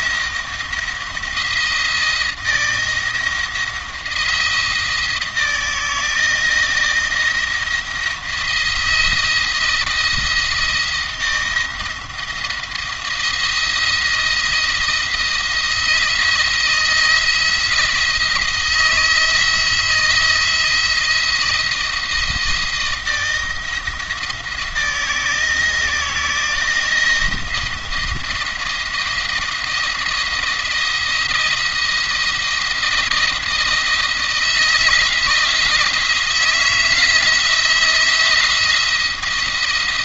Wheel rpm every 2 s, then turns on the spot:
170, 170, 160, 170, 170, 170, 170, 170, 170, 160, 170, 170, 160, 170, 170, 170, 170, 170, 170, 170.
none